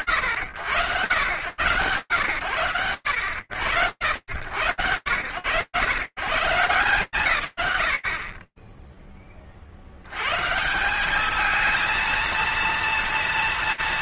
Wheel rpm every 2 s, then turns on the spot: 90, 100, 70, 140, 40, 130, 230.
none